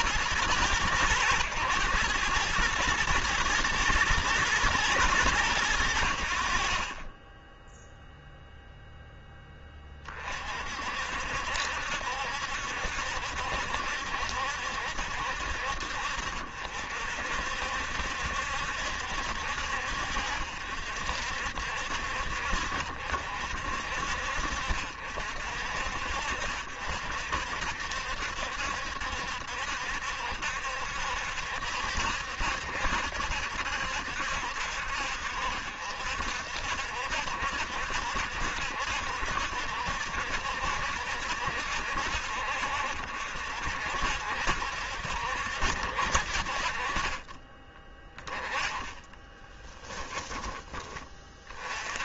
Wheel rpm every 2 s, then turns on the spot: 110, 110, 110, 30, 0, 50, 70, 60, 60, 70, 60, 60, 60, 60, 70, 70, 70, 60, 70, 70, 60, 60, 70, 30, 10, 20.
48-50